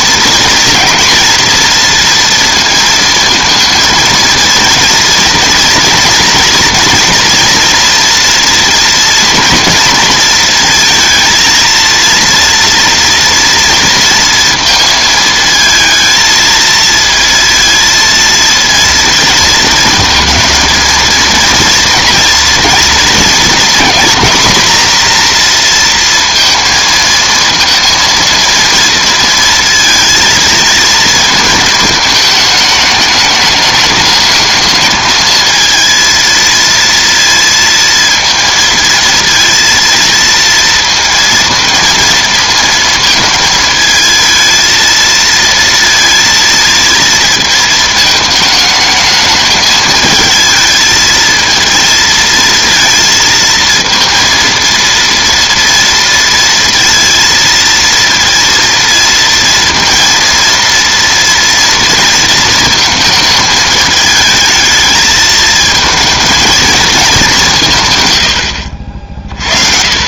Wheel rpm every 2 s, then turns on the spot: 240, 230, 230, 230, 230, 230, 230, 230, 230, 230, 230, 230, 230, 220, 230, 230, 210, 220, 230, 230, 230, 220, 230, 230, 220, 220, 230, 230, 230, 230, 230, 220, 220, 220, 80.
none